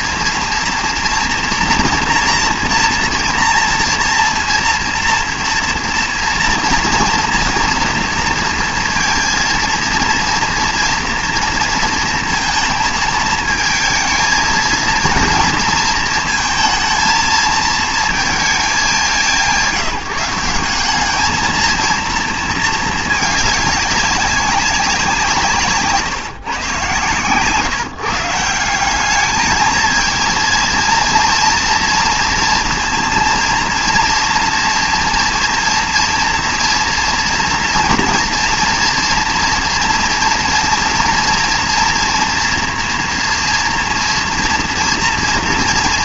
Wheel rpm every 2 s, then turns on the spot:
230, 230, 230, 230, 230, 230, 230, 230, 230, 220, 180, 230, 200, 130, 170, 230, 240, 240, 230, 230, 230, 230, 230.
none